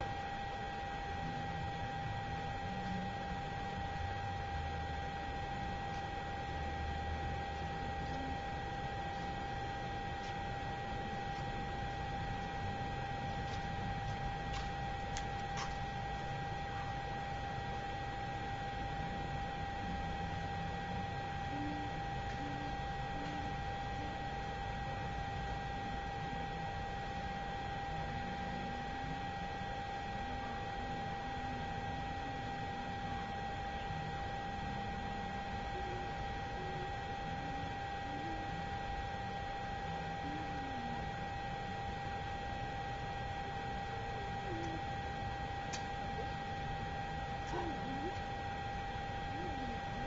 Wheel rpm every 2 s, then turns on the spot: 0, 0, 0, 0, 0, 0, 0, 0, 0, 0, 0, 0, 0, 0, 0, 0, 0, 0, 0, 0, 0, 0, 0, 0, 0.
none